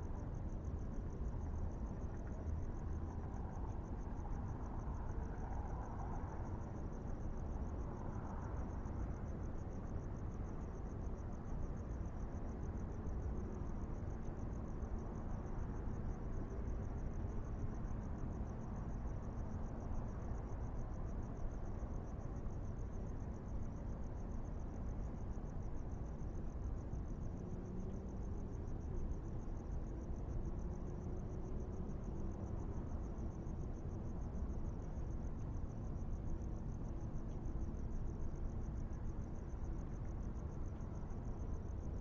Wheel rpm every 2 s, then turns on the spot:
0, 0, 0, 0, 0, 0, 0, 0, 0, 0, 0, 0, 0, 0, 0, 0, 0, 0, 0, 0, 0.
none